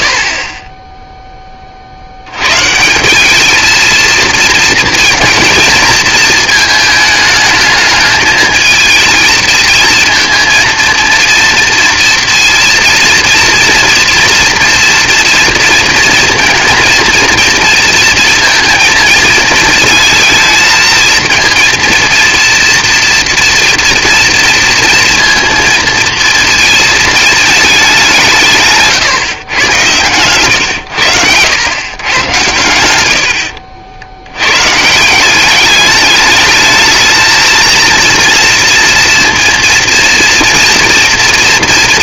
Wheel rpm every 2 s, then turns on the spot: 40, 130, 220, 220, 220, 230, 230, 230, 230, 230, 230, 230, 230, 230, 150, 110, 110, 100, 210, 230, 230.
none